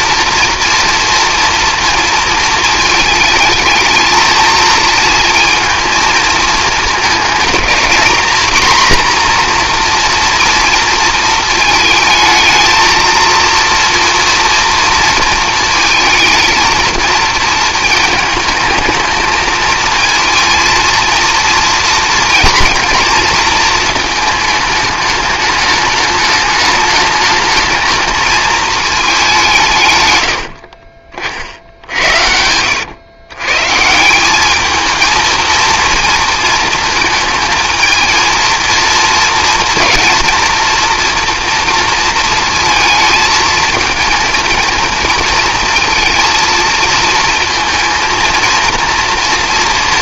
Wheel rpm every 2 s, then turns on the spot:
230, 220, 230, 220, 230, 230, 220, 230, 230, 220, 230, 230, 210, 210, 220, 60, 90, 220, 230, 230, 230, 220, 230, 230, 230.
30-32